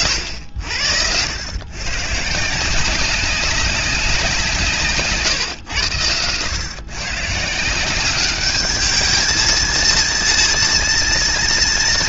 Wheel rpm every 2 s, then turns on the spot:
80, 170, 170, 110, 210, 230.
none